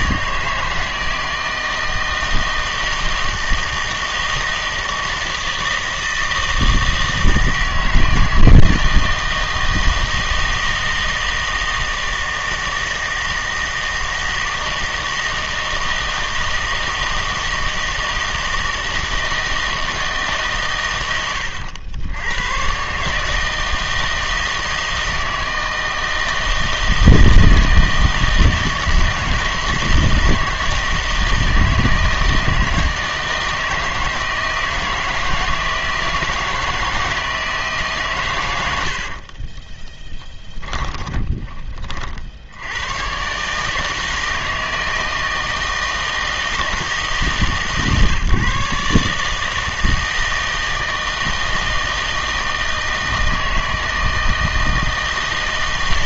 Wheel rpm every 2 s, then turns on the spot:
160, 160, 160, 160, 160, 160, 160, 160, 160, 160, 110, 120, 160, 160, 160, 160, 160, 160, 160, 90, 20, 90, 160, 160, 140, 160, 160, 160.
40-42